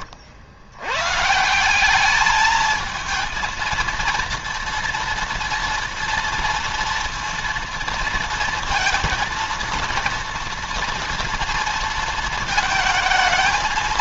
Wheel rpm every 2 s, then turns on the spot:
90, 220, 230, 230, 230, 230, 220.
none